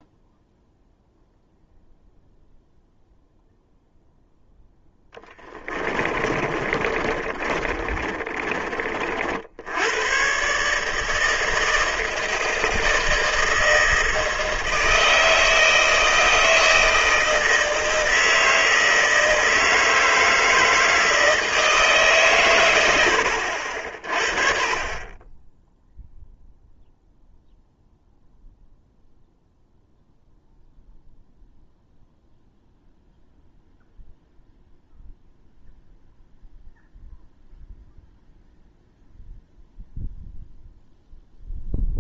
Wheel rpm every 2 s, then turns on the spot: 0, 0, 0, 40, 40, 140, 160, 160, 160, 160, 160, 110, 30, 0, 0, 0, 0, 0, 0, 0, 0.
6-8